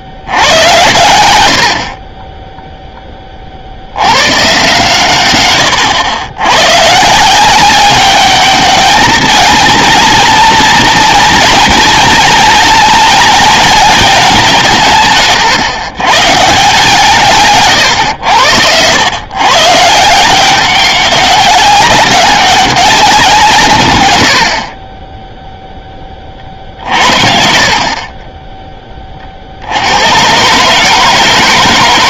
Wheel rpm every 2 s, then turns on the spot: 80, 10, 130, 130, 210, 230, 230, 180, 150, 90, 190, 200, 50, 50, 20, 150.
26-28